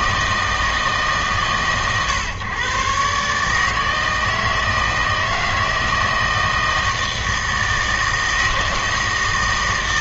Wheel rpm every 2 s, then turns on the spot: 160, 130, 160, 160, 160.
none